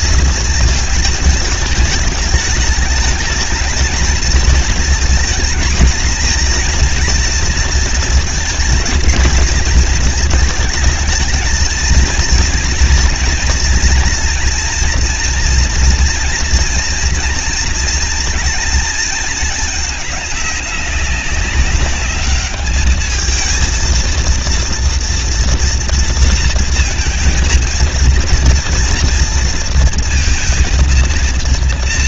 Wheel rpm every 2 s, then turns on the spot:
220, 220, 230, 230, 230, 220, 230, 240, 230, 230, 210, 210, 230, 230, 230, 230.
none